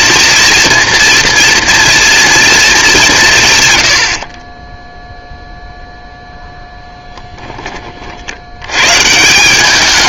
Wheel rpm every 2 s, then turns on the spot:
230, 220, 20, 0, 100.
4-6